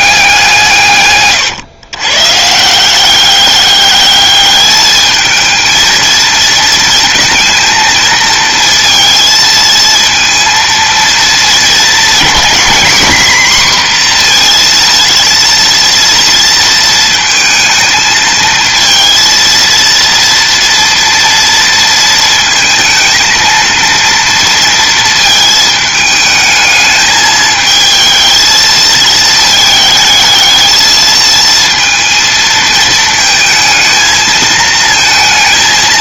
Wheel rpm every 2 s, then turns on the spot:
150, 170, 210, 230, 230, 230, 240, 230, 230, 230, 230, 230, 230, 220, 220, 220, 220, 220.
none